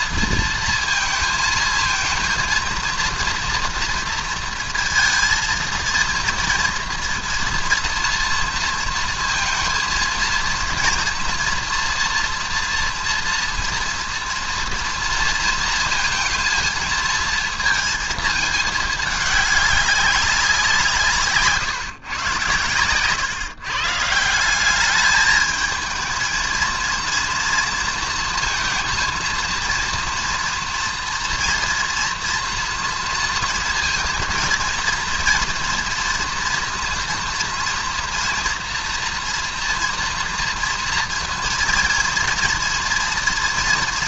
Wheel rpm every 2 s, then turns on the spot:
230, 230, 230, 240, 230, 230, 230, 230, 230, 220, 200, 130, 160, 220, 230, 240, 230, 230, 230, 230, 230, 230.
none